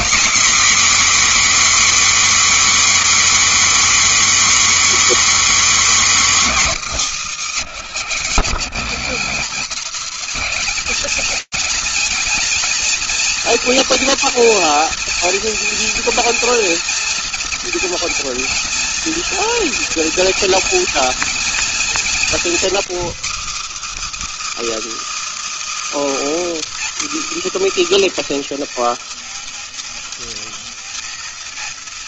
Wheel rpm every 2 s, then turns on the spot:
240, 290, 290, 270, 160, 180, 230, 240, 240, 240, 230, 240, 320, 310, 270, 230.
none